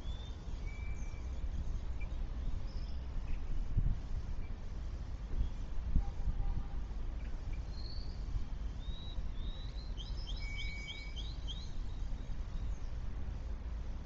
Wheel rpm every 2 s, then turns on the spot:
0, 0, 0, 0, 0, 0, 0.
none